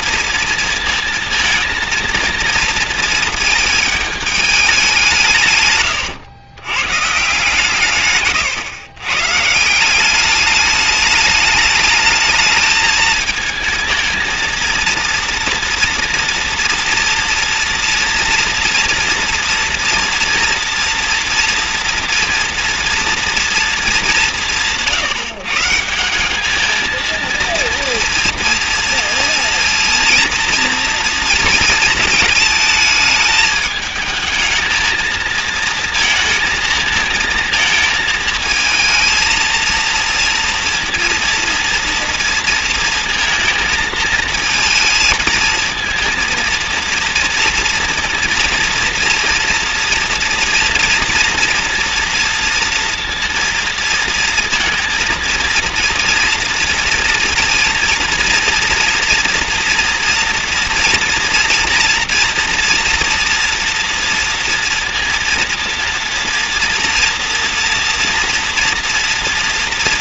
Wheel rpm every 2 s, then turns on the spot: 230, 230, 210, 110, 120, 210, 220, 230, 240, 230, 230, 230, 170, 210, 230, 230, 220, 220, 220, 220, 230, 230, 220, 230, 240, 240, 230, 230, 230, 230, 230, 230, 230, 230, 230.
none